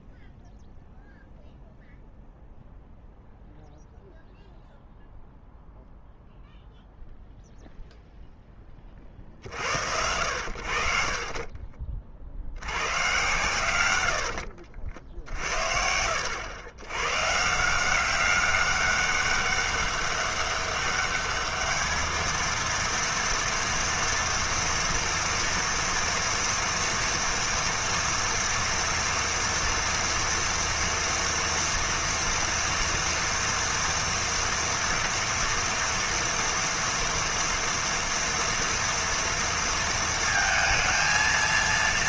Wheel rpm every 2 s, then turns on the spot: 0, 0, 0, 0, 20, 60, 110, 60, 90, 200, 200, 230, 230, 230, 230, 240, 230, 230, 230, 240, 220.
14-16